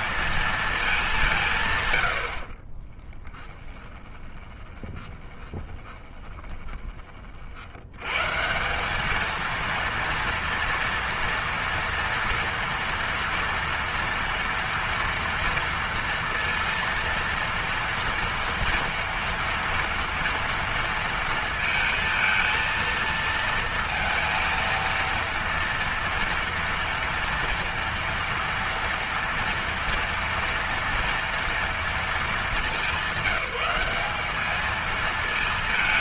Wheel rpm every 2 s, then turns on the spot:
230, 100, 20, 20, 120, 230, 230, 230, 230, 230, 230, 230, 230, 230, 230, 230, 210, 200.
4-8